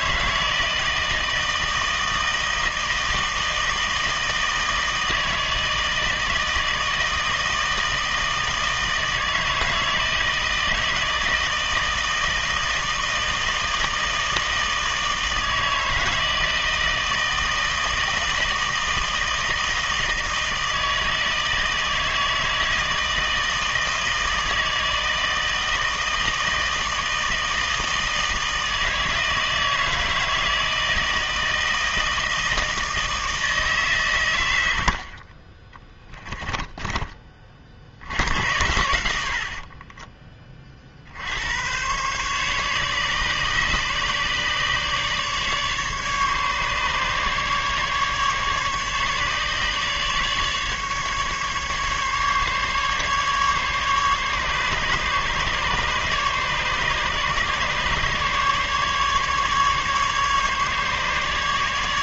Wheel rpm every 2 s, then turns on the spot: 160, 160, 160, 160, 160, 160, 160, 160, 160, 160, 160, 160, 160, 160, 160, 160, 160, 90, 20, 90, 30, 140, 150, 140, 140, 150, 140, 140, 140, 150, 150.
36-40